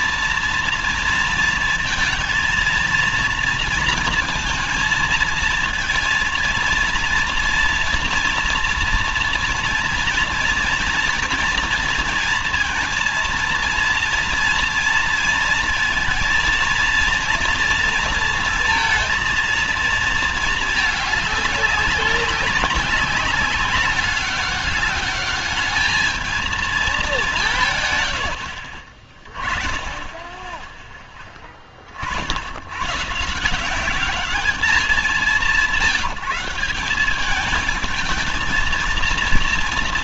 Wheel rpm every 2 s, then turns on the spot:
230, 230, 230, 230, 230, 240, 230, 230, 230, 230, 220, 200, 200, 220, 50, 20, 90, 200, 180, 220.
none